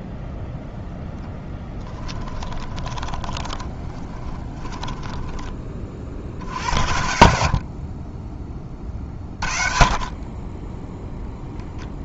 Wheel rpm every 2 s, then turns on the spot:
0, 20, 20, 60, 20, 10.
2-6